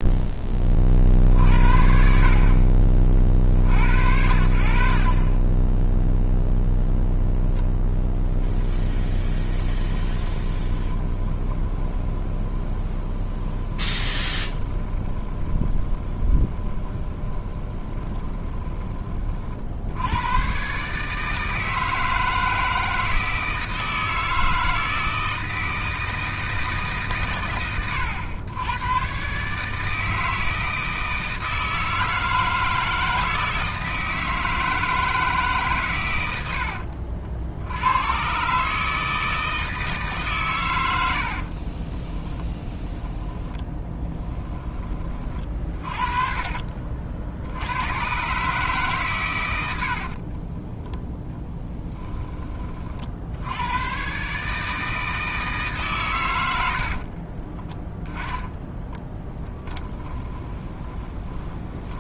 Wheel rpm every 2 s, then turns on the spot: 20, 40, 60, 0, 0, 20, 20, 20, 20, 20, 130, 160, 160, 160, 100, 160, 160, 160, 80, 140, 120, 10, 10, 40, 140, 30, 30, 150, 80, 10, 20.
10-20 50-52 56-62